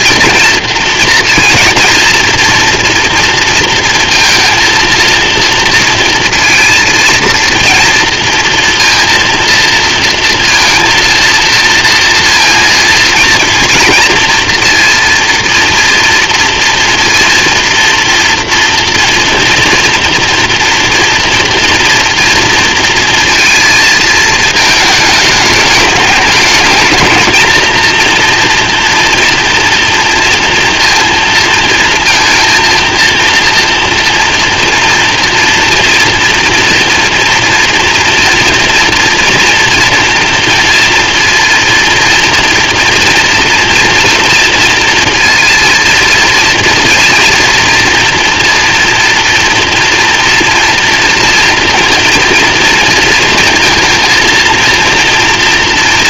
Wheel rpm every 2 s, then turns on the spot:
230, 230, 230, 230, 230, 230, 230, 230, 230, 230, 230, 230, 210, 220, 240, 230, 230, 240, 230, 230, 230, 240, 230, 230, 230, 230, 230, 230.
none